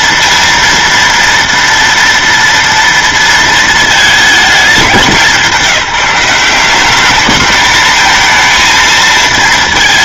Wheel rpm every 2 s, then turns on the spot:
230, 230, 210, 190, 220.
none